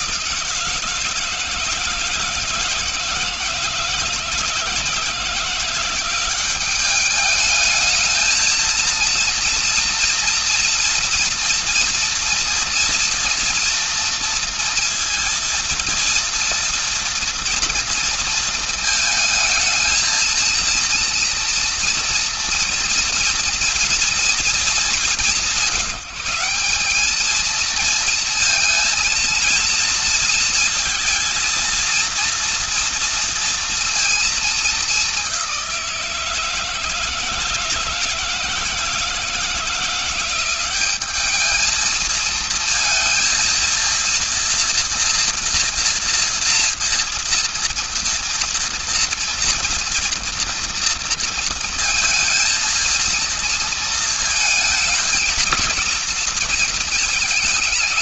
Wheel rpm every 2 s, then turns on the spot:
160, 160, 180, 220, 230, 240, 230, 230, 230, 220, 230, 240, 180, 230, 230, 230, 230, 180, 160, 170, 220, 230, 230, 230, 230, 230, 230, 230, 220.
none